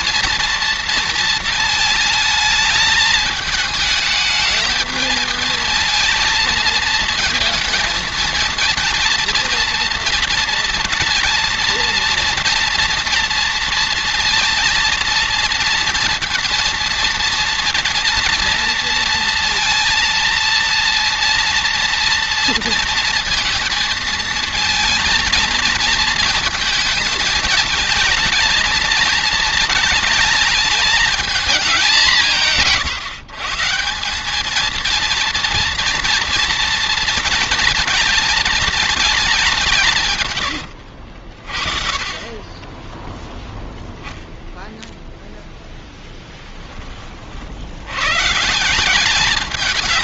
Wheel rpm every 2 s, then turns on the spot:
230, 220, 220, 220, 230, 230, 230, 230, 230, 230, 230, 230, 230, 220, 220, 220, 160, 210, 240, 220, 90, 10, 0, 10, 150.
40-42